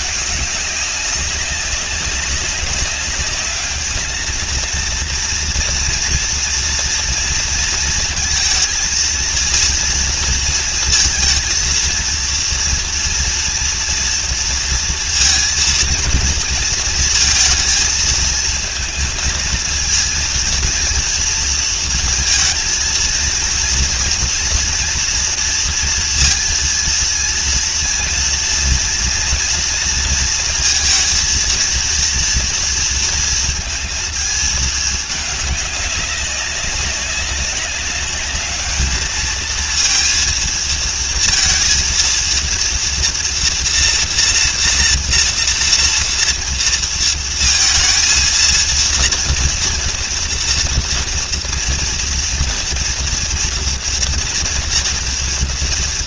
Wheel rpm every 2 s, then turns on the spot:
200, 200, 230, 230, 230, 230, 230, 230, 230, 230, 230, 230, 230, 230, 230, 230, 230, 210, 200, 220, 230, 230, 230, 230, 230, 230, 230, 230.
none